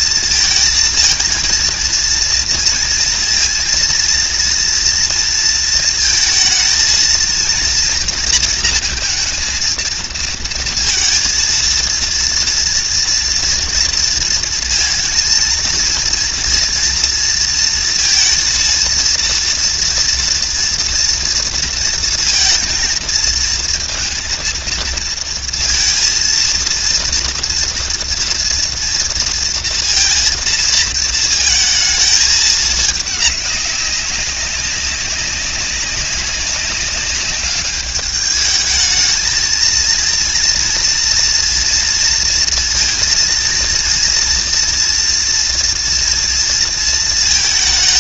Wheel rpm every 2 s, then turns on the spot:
220, 230, 230, 220, 230, 230, 230, 230, 230, 230, 230, 230, 230, 230, 230, 230, 210, 200, 190, 220, 230, 230, 230, 230.
none